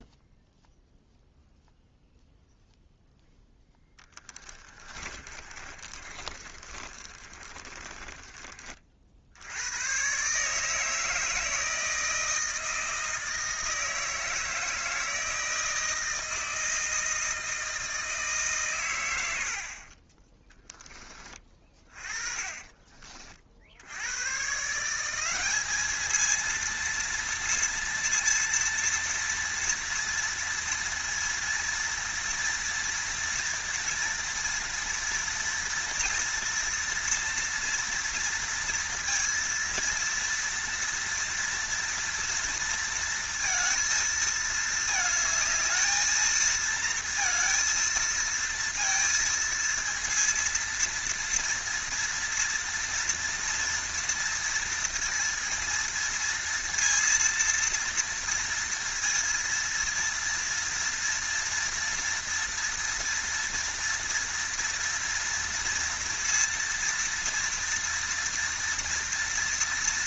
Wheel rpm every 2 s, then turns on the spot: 0, 0, 20, 40, 30, 150, 160, 160, 160, 140, 20, 30, 140, 230, 230, 230, 230, 230, 230, 230, 230, 230, 220, 230, 230, 230, 230, 230, 230, 230, 230, 230, 230, 230, 230.
4-8 22-24